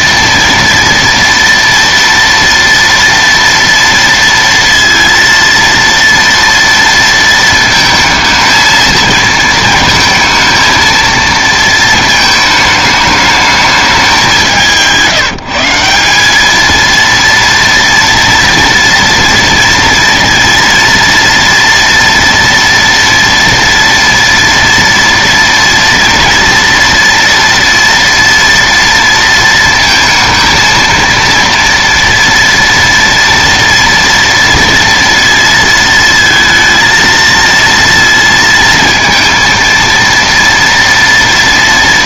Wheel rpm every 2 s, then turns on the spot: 230, 230, 230, 230, 230, 230, 210, 170, 230, 230, 230, 230, 230, 240, 230, 230, 230, 230, 230, 230, 230.
none